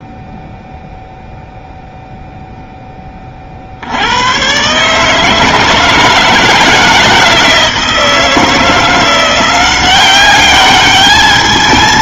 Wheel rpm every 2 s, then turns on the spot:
0, 0, 130, 160, 170, 200.
none